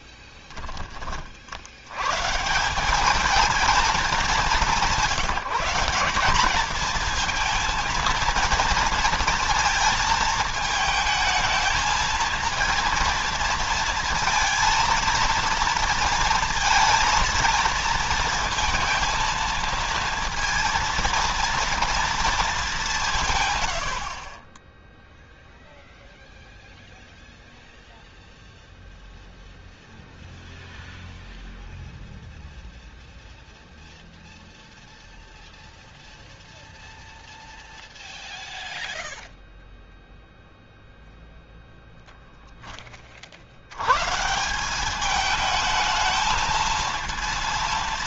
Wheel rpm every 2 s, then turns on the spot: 30, 190, 200, 220, 230, 220, 230, 230, 230, 230, 230, 180, 10, 0, 0, 0, 0, 0, 0, 0, 0, 20, 190, 230.
none